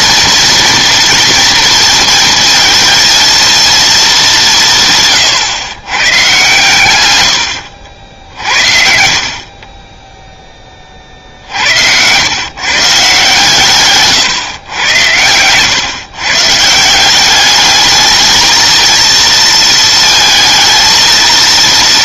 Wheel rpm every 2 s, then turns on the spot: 230, 230, 160, 130, 60, 30, 140, 110, 150, 220, 220.
none